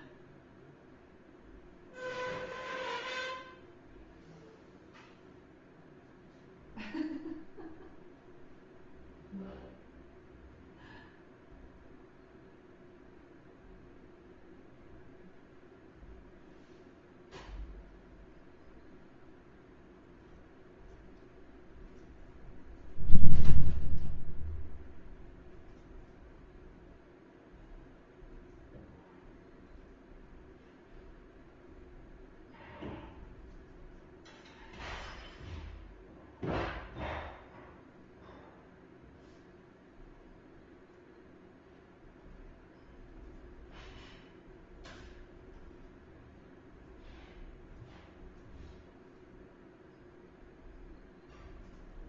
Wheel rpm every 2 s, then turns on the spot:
0, 0, 0, 0, 0, 0, 0, 0, 0, 0, 0, 0, 0, 0, 0, 0, 0, 0, 0, 0, 0, 0, 0, 0, 0, 0.
none